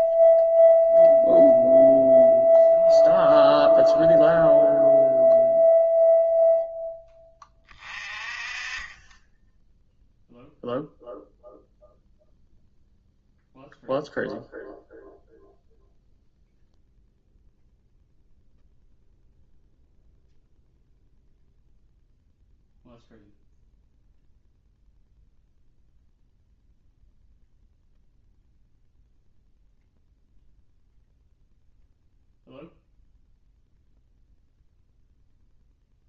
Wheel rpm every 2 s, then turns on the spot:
0, 0, 0, 0, 30, 0, 0, 0, 0, 0, 0, 0, 0, 0, 0, 0, 0, 0.
none